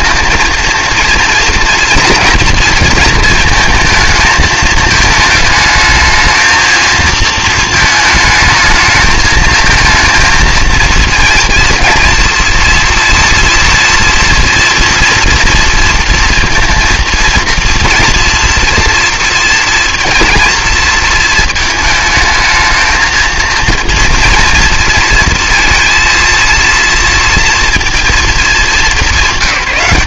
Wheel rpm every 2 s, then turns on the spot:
230, 230, 220, 220, 220, 230, 230, 230, 230, 230, 230, 220, 230, 230, 210.
none